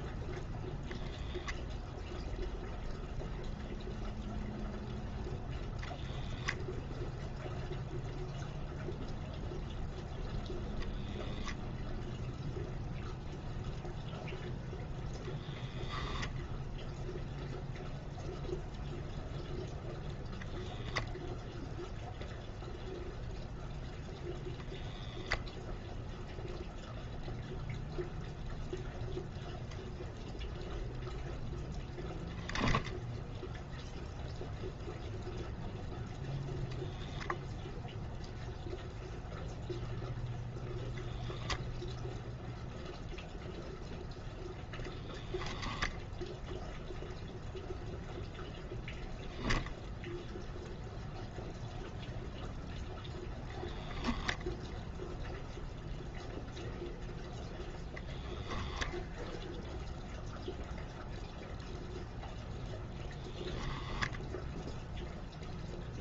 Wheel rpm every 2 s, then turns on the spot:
0, 0, 0, 0, 0, 0, 0, 0, 0, 0, 0, 0, 0, 0, 0, 0, 0, 0, 0, 0, 0, 0, 0, 0, 0, 0, 0, 0, 0, 0, 0, 0, 0.
none